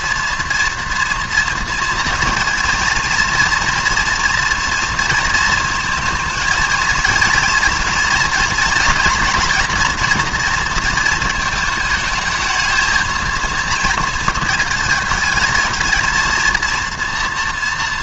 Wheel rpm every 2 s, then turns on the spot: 230, 230, 230, 220, 240, 230, 220, 220, 230.
none